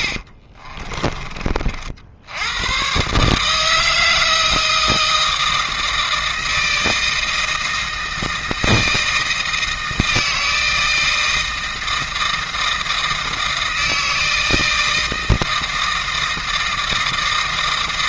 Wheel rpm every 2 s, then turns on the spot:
30, 110, 160, 160, 160, 160, 160, 160, 160.
0-2